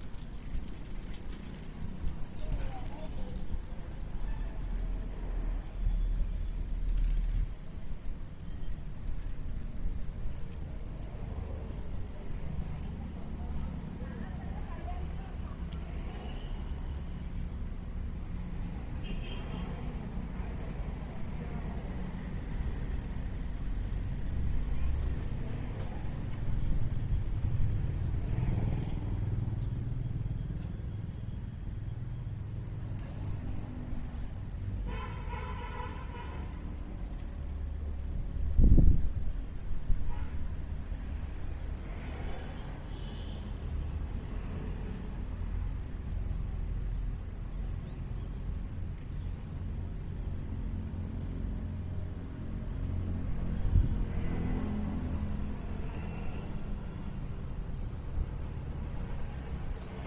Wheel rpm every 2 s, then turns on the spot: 0, 0, 0, 0, 0, 0, 0, 0, 0, 0, 0, 0, 0, 0, 0, 0, 0, 0, 0, 0, 0, 0, 0, 0, 0, 0, 0, 0, 0, 0.
none